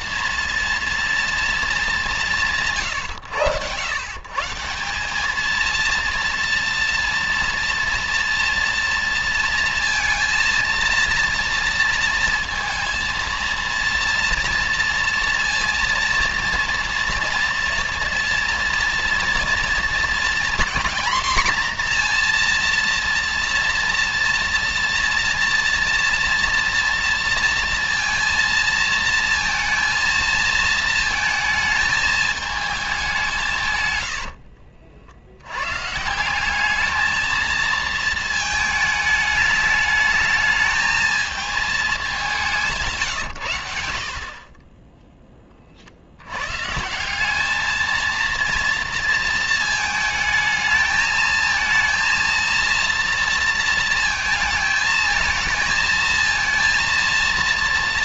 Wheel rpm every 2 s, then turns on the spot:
210, 110, 230, 230, 230, 230, 230, 230, 230, 230, 240, 230, 230, 230, 230, 220, 150, 90, 220, 210, 220, 110, 10, 190, 230, 220, 230, 220, 230.
none